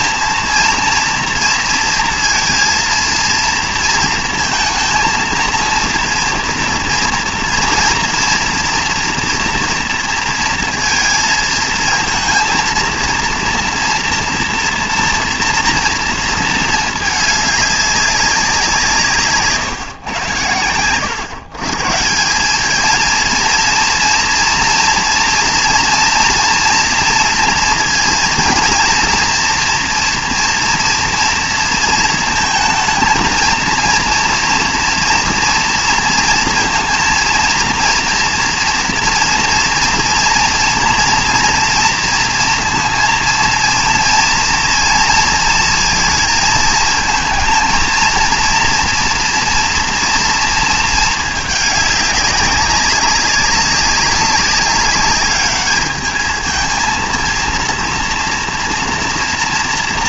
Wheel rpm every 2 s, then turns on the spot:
230, 230, 230, 230, 230, 230, 230, 230, 220, 180, 110, 200, 230, 230, 230, 230, 230, 230, 230, 230, 230, 230, 230, 220, 230, 230, 200, 200, 220, 230.
none